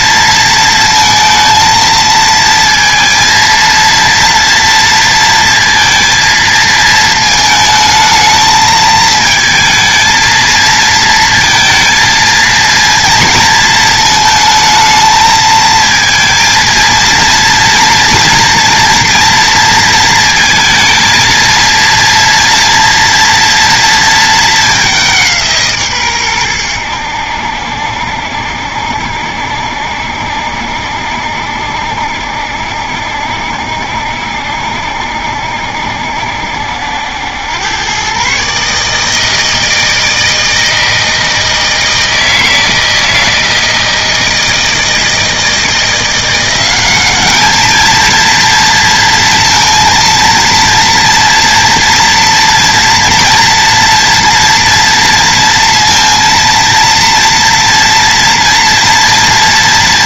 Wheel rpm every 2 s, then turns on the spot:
230, 230, 230, 220, 220, 230, 230, 220, 230, 230, 230, 230, 190, 90, 70, 70, 70, 70, 80, 150, 160, 160, 160, 200, 230, 230, 230, 230, 230, 230.
none